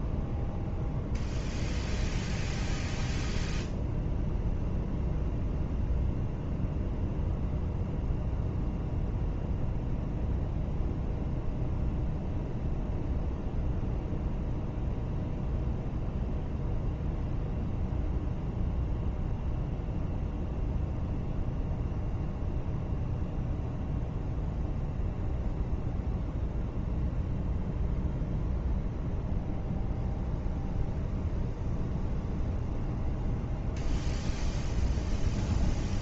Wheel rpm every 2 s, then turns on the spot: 0, 0, 0, 0, 0, 0, 0, 0, 0, 0, 0, 0, 0, 0, 0, 0, 0, 0.
none